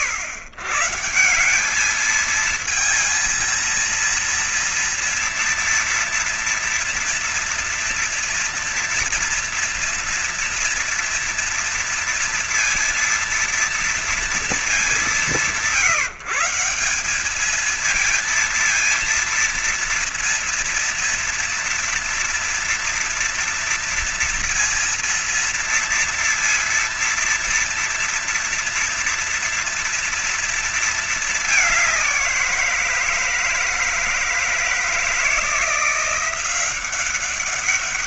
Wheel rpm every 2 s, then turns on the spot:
130, 220, 230, 240, 230, 230, 230, 220, 170, 230, 230, 230, 240, 230, 230, 230, 180, 160, 180.
none